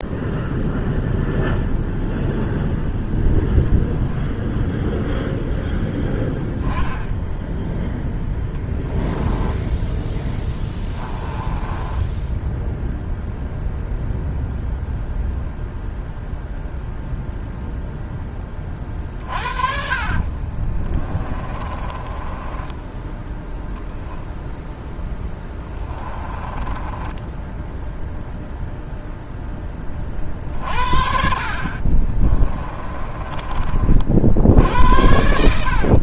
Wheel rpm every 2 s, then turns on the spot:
0, 0, 0, 10, 10, 10, 0, 0, 0, 30, 20, 10, 0, 10, 0, 50, 30, 80.
8-12 20-24 26-28 32-34